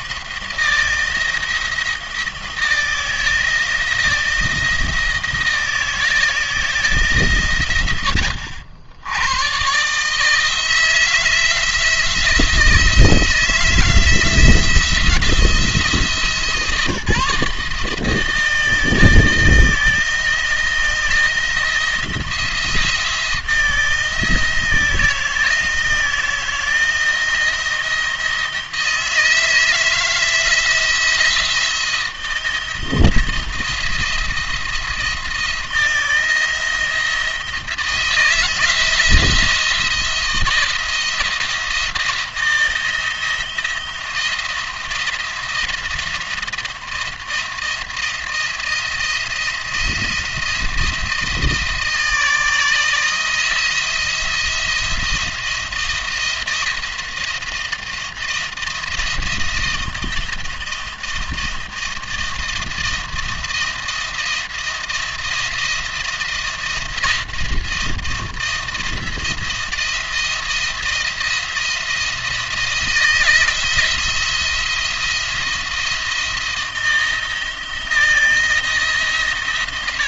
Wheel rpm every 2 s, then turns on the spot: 170, 160, 160, 160, 80, 160, 160, 160, 160, 160, 160, 170, 170, 160, 160, 160, 170, 170, 170, 170, 170, 170, 170, 170, 170, 170, 160, 170, 170, 170, 170, 170, 170, 170, 170, 170, 160, 170, 170, 150.
none